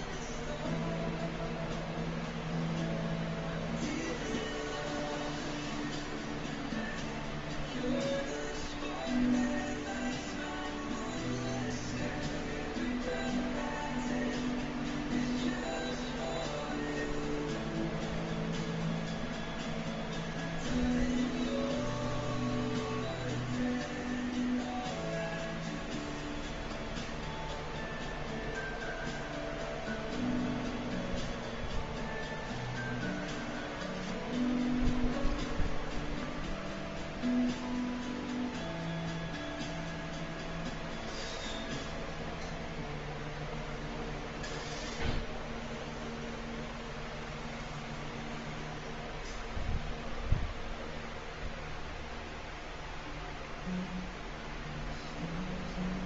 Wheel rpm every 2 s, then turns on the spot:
0, 0, 0, 0, 0, 0, 0, 0, 0, 0, 0, 0, 0, 0, 0, 0, 0, 0, 0, 0, 0, 0, 0, 0, 0, 0, 0, 0.
none